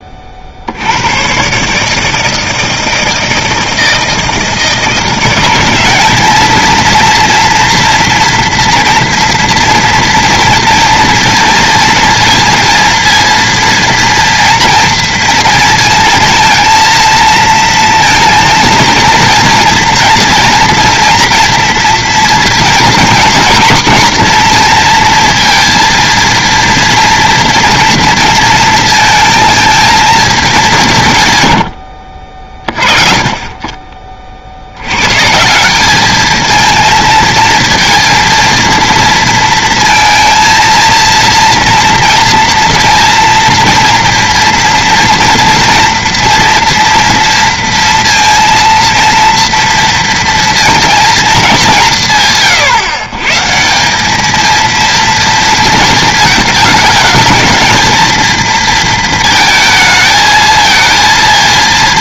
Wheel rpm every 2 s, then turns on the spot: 50, 160, 160, 220, 230, 230, 230, 230, 230, 230, 230, 230, 230, 230, 220, 200, 40, 60, 220, 230, 230, 230, 230, 230, 230, 230, 130, 220, 220, 230, 220.
none